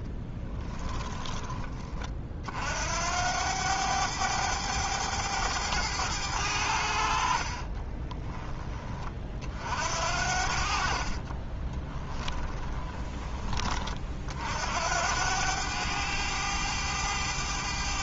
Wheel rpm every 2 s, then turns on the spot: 20, 70, 100, 70, 20, 50, 20, 80, 100.
0-2 10-12